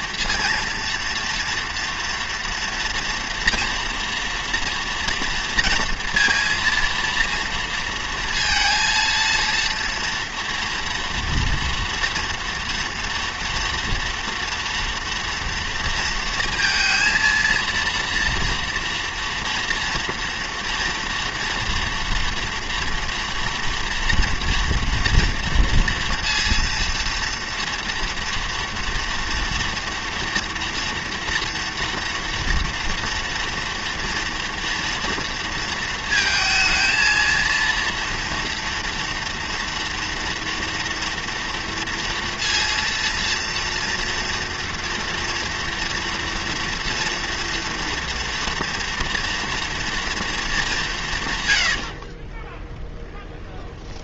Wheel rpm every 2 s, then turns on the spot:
230, 230, 230, 230, 230, 230, 240, 230, 230, 230, 230, 230, 230, 230, 240, 230, 230, 230, 220, 230, 230, 230, 230, 230, 240, 200, 20.
52-54